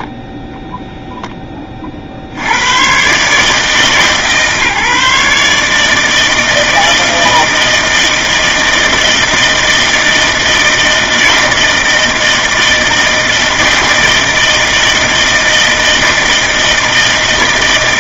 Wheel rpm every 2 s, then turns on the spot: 0, 110, 150, 160, 160, 160, 160, 160, 160.
none